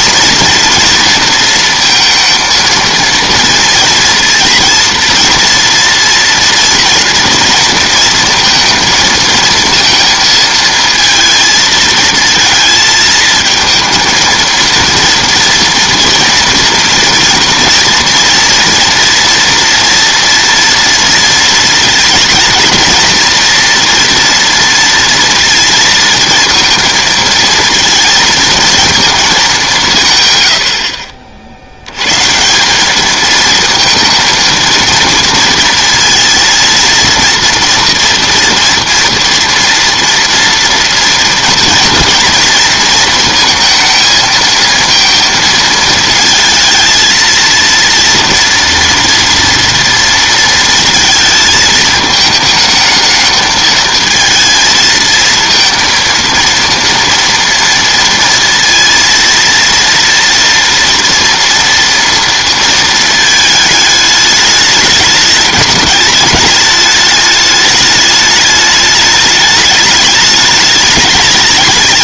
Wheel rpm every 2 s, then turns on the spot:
230, 230, 230, 230, 230, 230, 230, 230, 230, 240, 230, 230, 230, 230, 220, 80, 180, 230, 230, 230, 230, 230, 220, 220, 230, 230, 210, 230, 230, 230, 230, 230, 210, 210, 210, 210.
none